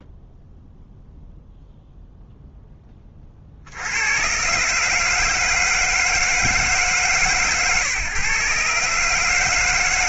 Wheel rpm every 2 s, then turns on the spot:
0, 10, 140, 150, 140.
none